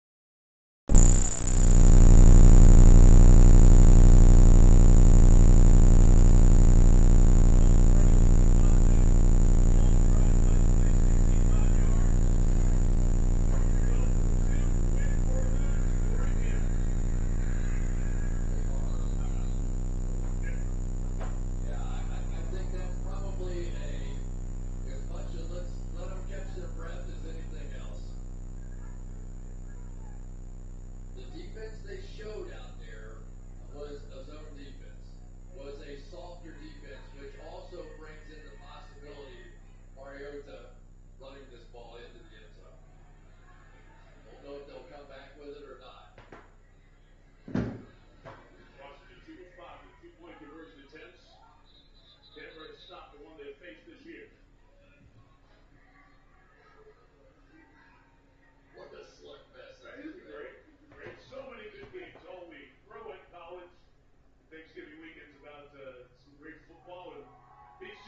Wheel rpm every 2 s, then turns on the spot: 0, 0, 0, 0, 0, 0, 0, 0, 0, 0, 0, 0, 0, 0, 0, 0, 0, 0, 0, 0, 0, 0, 0, 0, 0, 0, 0, 0, 0, 0, 0, 0, 0, 0.
none